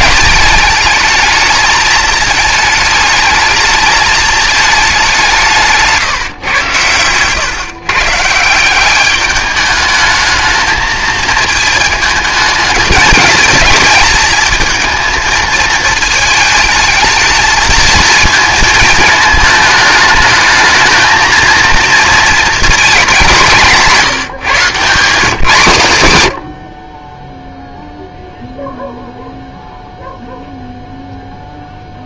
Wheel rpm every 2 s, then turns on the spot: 220, 220, 220, 130, 180, 220, 220, 220, 220, 220, 220, 220, 170, 70, 0, 0.
26-28